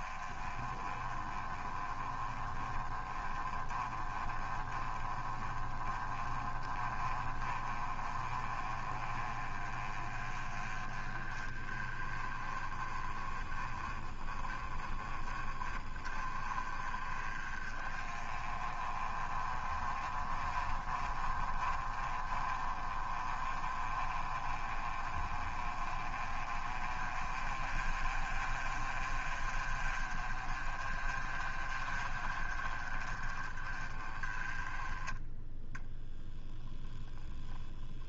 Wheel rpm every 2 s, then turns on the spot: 20, 20, 20, 30, 30, 20, 20, 30, 30, 30, 30, 30, 30, 30, 30, 30, 30, 10, 0.
none